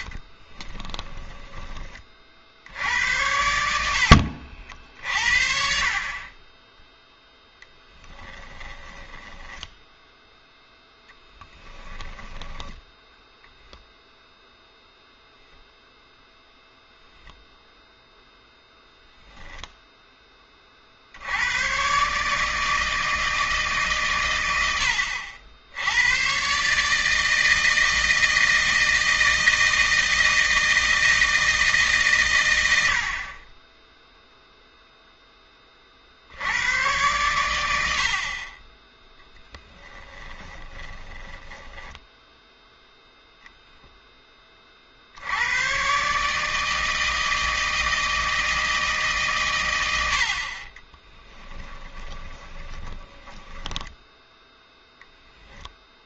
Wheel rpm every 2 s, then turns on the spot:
10, 80, 60, 10, 20, 0, 10, 0, 0, 0, 40, 160, 90, 140, 160, 160, 90, 0, 100, 30, 20, 0, 30, 160, 160, 30, 10, 0.
0-2 8-10 40-42 50-54